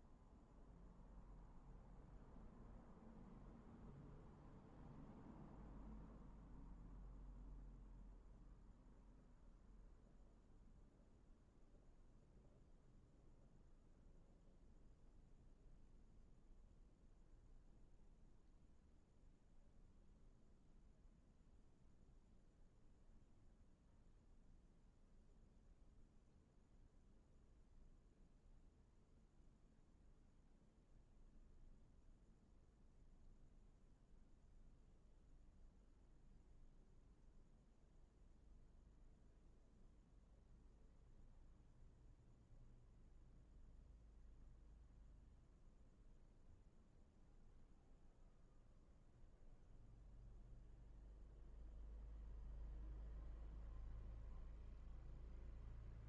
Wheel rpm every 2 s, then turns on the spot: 0, 0, 0, 0, 0, 0, 0, 0, 0, 0, 0, 0, 0, 0, 0, 0, 0, 0, 0, 0, 0, 0, 0, 0, 0, 0, 0, 0.
none